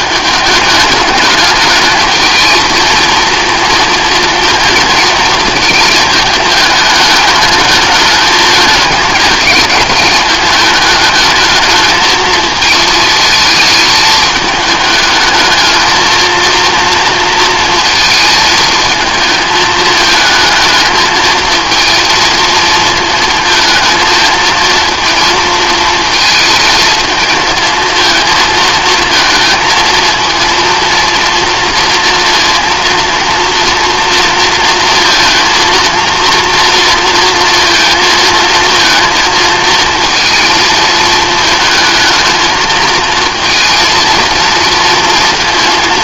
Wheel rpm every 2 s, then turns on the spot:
210, 220, 230, 210, 210, 210, 220, 210, 230, 220, 220, 230, 230, 220, 220, 230, 230, 230, 230, 230, 220, 230, 230.
none